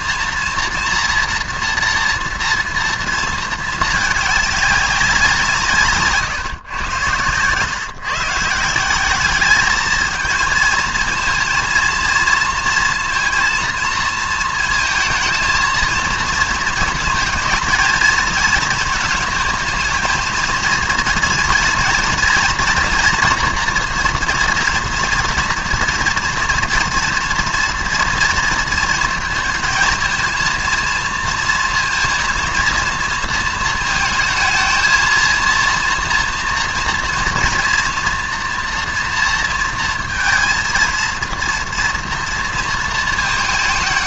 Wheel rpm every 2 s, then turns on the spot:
230, 230, 200, 120, 180, 230, 230, 220, 220, 230, 230, 230, 230, 230, 230, 220, 230, 230, 240, 230, 230, 230.
none